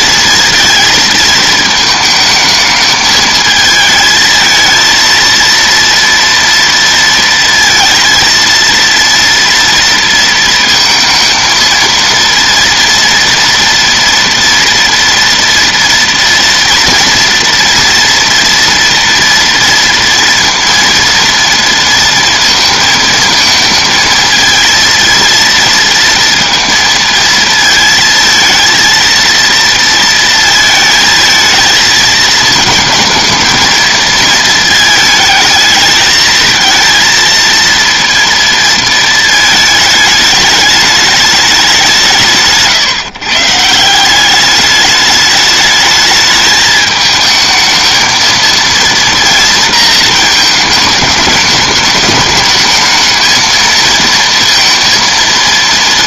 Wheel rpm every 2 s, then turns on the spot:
220, 220, 230, 230, 230, 230, 230, 230, 230, 230, 230, 220, 230, 230, 230, 220, 220, 220, 220, 220, 210, 130, 210, 220, 230, 210, 220, 230.
none